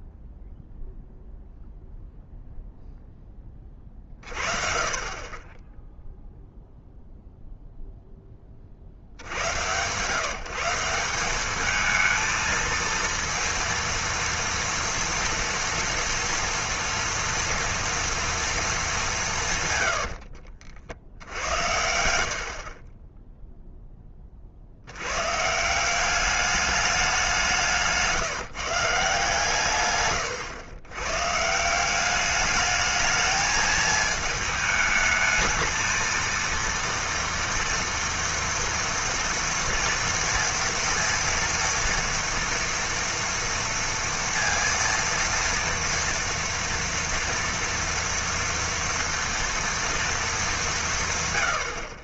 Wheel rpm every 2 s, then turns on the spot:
0, 0, 40, 0, 30, 170, 220, 230, 230, 220, 60, 30, 60, 210, 160, 120, 210, 220, 230, 230, 230, 230, 230, 230, 230, 200.
22-24